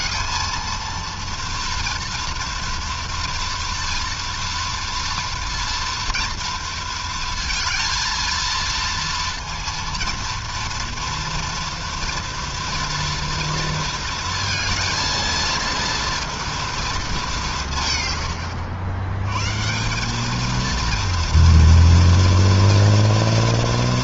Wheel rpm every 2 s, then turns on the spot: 230, 230, 230, 230, 230, 230, 230, 230, 190, 120, 230, 230.
none